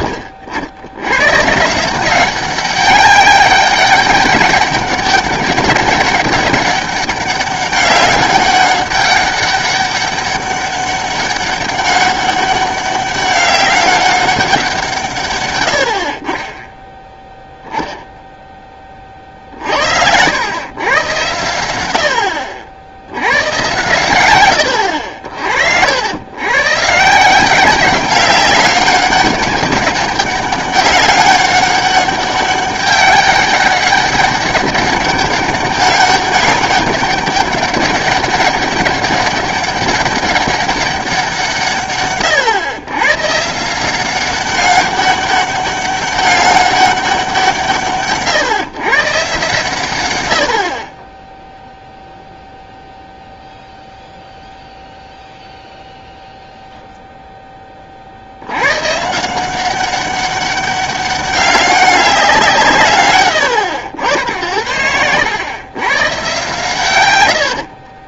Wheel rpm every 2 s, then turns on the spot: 90, 190, 200, 200, 190, 200, 200, 190, 30, 0, 110, 70, 100, 120, 190, 200, 200, 200, 200, 200, 200, 110, 200, 200, 130, 70, 0, 0, 0, 110, 200, 190, 70, 130.
24-26